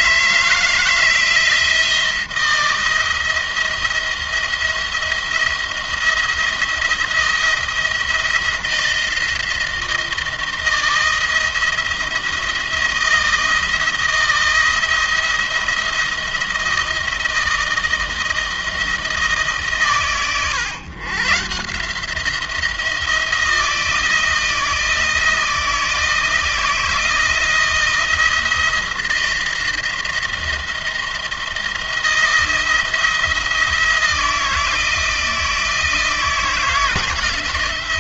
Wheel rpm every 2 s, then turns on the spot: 160, 170, 170, 170, 170, 160, 170, 170, 160, 160, 120, 170, 160, 170, 170, 170, 170, 170, 160.
none